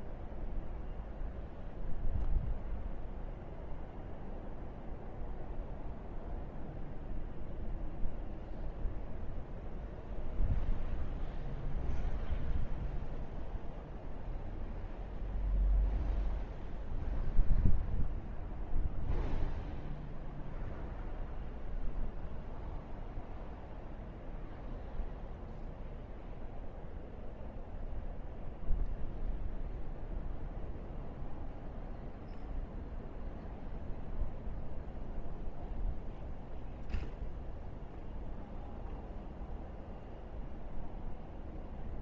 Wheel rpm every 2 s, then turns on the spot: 0, 0, 0, 0, 0, 0, 0, 0, 0, 0, 0, 0, 0, 0, 0, 0, 0, 0, 0, 0, 0.
none